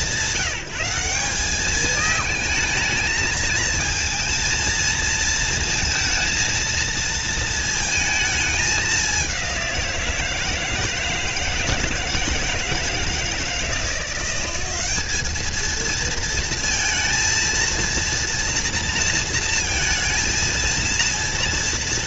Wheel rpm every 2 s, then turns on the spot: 190, 220, 220, 230, 210, 160, 160, 190, 230, 230, 230.
none